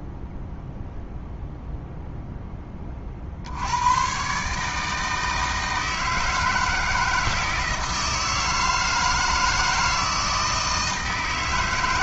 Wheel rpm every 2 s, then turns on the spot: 0, 30, 150, 160, 160, 160.
none